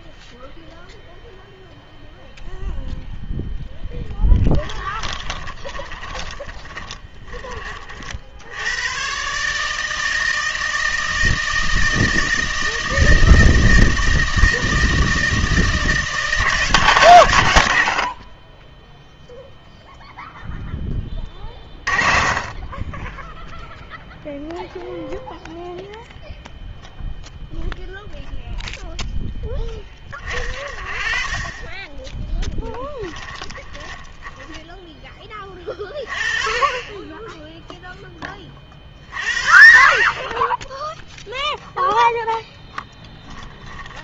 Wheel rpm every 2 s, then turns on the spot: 0, 0, 10, 20, 90, 160, 160, 160, 170, 20, 10, 20, 0, 0, 0, 30, 10, 10, 20, 40, 10, 0.
4-8 32-34